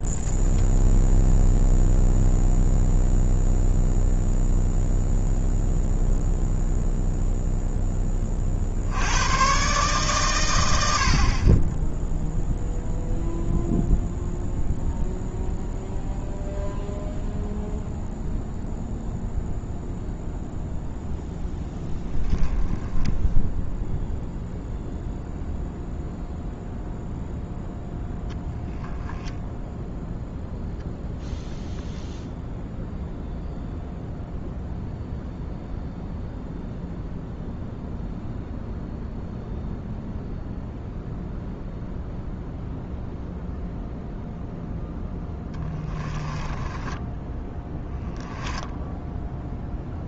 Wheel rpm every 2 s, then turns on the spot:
0, 0, 0, 0, 70, 80, 0, 0, 0, 0, 0, 10, 0, 0, 0, 0, 0, 0, 0, 0, 0, 0, 0, 10, 0.
46-48